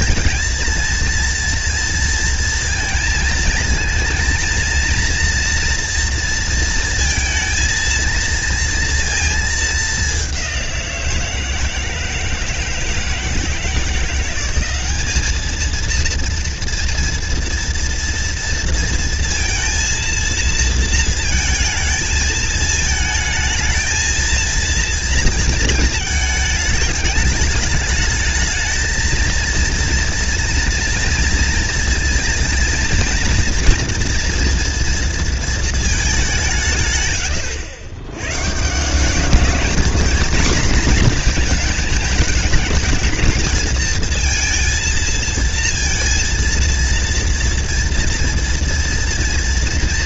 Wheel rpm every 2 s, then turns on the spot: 230, 220, 230, 230, 230, 170, 160, 200, 230, 230, 230, 220, 230, 210, 220, 230, 230, 230, 120, 180, 240, 210, 230, 230, 230.
none